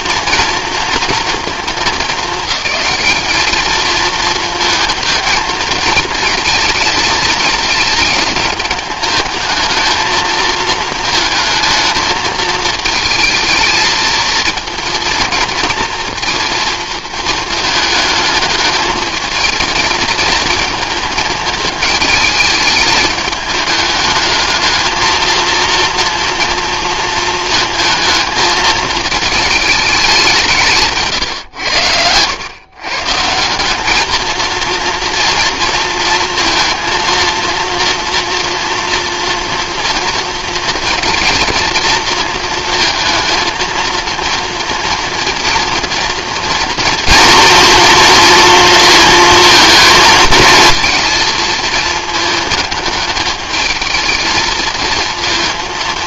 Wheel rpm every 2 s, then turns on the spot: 230, 200, 220, 220, 210, 220, 220, 230, 230, 220, 220, 220, 220, 230, 220, 160, 120, 230, 230, 230, 230, 220, 230, 230, 230, 230, 210, 220.
none